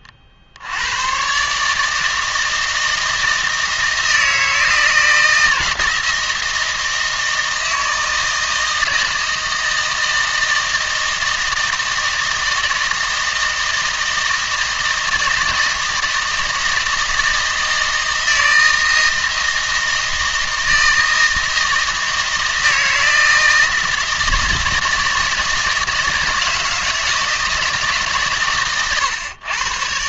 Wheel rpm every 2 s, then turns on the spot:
60, 160, 160, 160, 160, 160, 160, 160, 160, 160, 160, 160, 160, 160, 120.
none